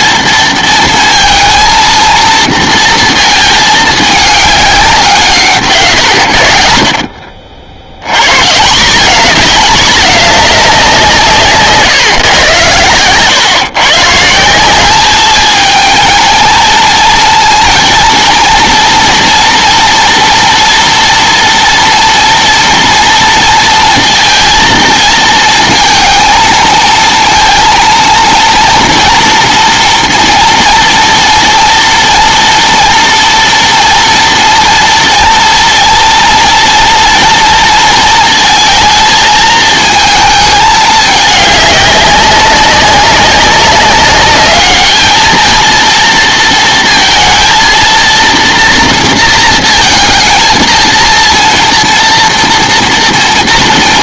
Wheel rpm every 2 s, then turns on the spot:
230, 230, 180, 60, 190, 190, 110, 190, 230, 230, 230, 230, 220, 230, 230, 230, 230, 230, 230, 220, 210, 190, 210, 230, 230, 230, 230.
none